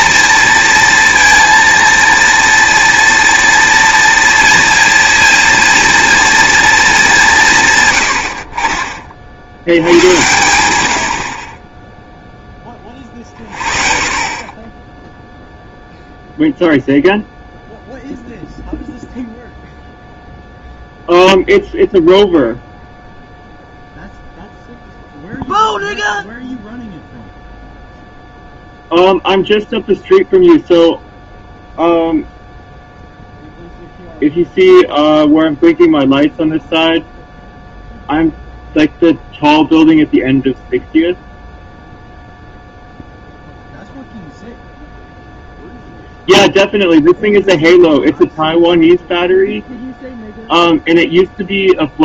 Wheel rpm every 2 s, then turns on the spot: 230, 230, 230, 220, 40, 90, 30, 20, 0, 0, 0, 0, 0, 0, 0, 0, 0, 0, 0, 0, 0, 0, 0, 0, 0, 0.
none